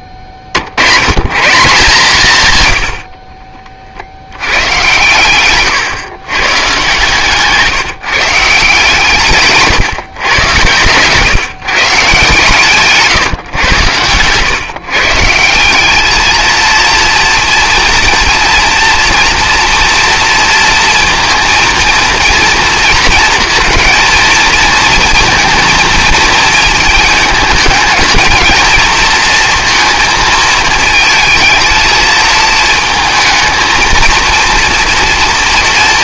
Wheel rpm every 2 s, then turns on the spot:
50, 90, 110, 140, 140, 120, 140, 140, 230, 230, 230, 230, 220, 220, 220, 220, 220, 230.
10-12